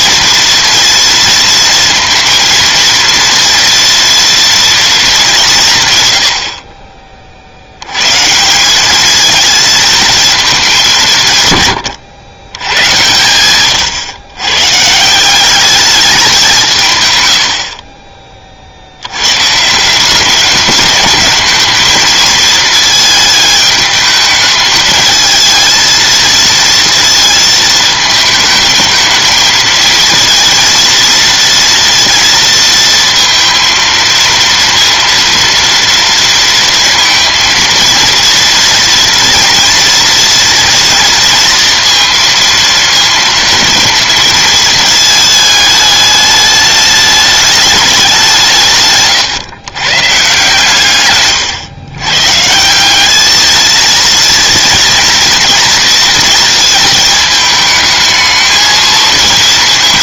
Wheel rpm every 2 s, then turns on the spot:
230, 230, 220, 30, 210, 180, 100, 150, 150, 70, 210, 220, 220, 230, 220, 230, 230, 230, 230, 230, 230, 230, 220, 210, 140, 130, 200, 230, 220, 220.
none